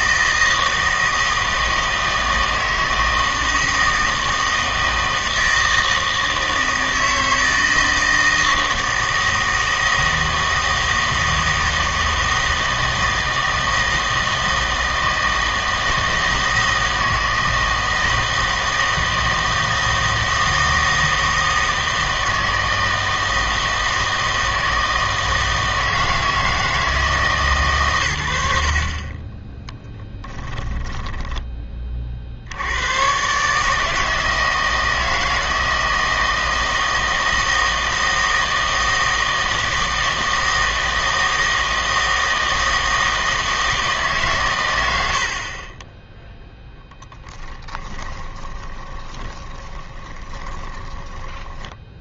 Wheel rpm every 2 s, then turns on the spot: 160, 160, 160, 160, 160, 160, 160, 160, 160, 160, 160, 160, 160, 160, 60, 20, 80, 160, 160, 160, 160, 160, 110, 0, 20, 20.
28-32 48-52